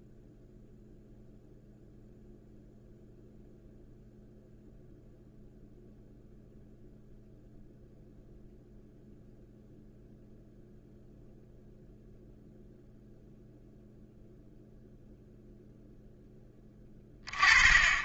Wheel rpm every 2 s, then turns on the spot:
0, 0, 0, 0, 0, 0, 0, 0, 20.
none